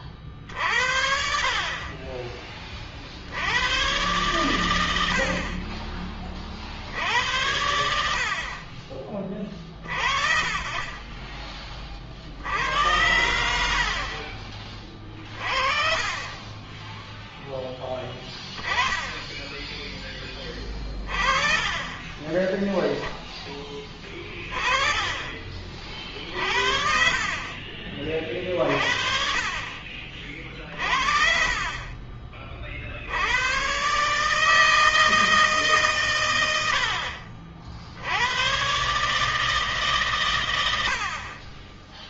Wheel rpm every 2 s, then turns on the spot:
60, 50, 100, 60, 30, 20, 80, 30, 10, 10, 20, 10, 20, 50, 50, 40, 50, 160, 100, 110, 120.
18-20 24-26